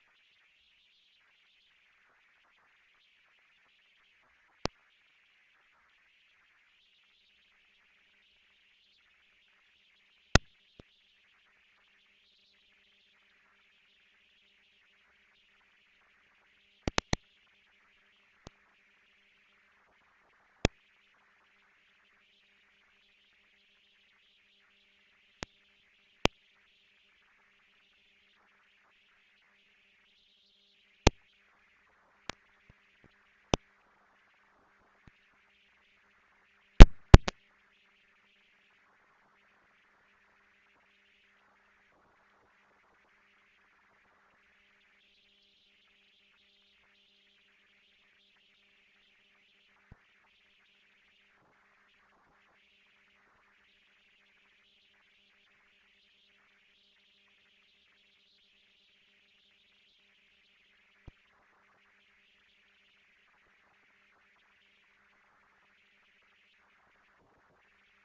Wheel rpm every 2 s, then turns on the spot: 80, 100, 160, 200, 220, 210, 220, 220, 230, 240, 230, 240, 210, 210, 230, 230, 230, 230, 190, 20, 210, 230, 210, 170, 160, 180, 210, 230, 230, 230, 230, 220, 230, 240.
none